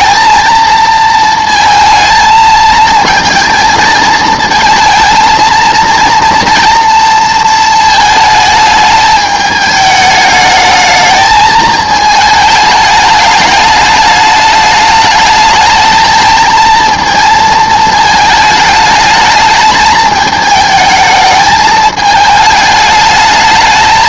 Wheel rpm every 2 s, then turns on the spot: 220, 220, 220, 230, 220, 220, 210, 210, 220, 220, 220, 210.
none